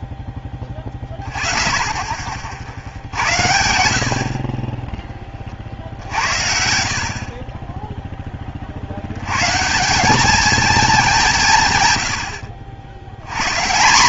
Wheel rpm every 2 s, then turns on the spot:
10, 50, 20, 80, 30, 210, 70.
none